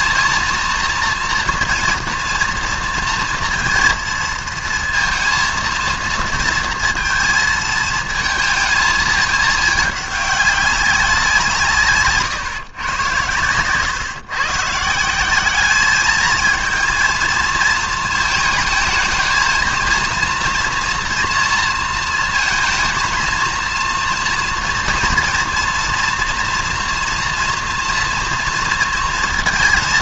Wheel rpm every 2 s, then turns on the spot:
230, 230, 230, 230, 220, 190, 120, 160, 230, 220, 240, 230, 230, 230, 230.
none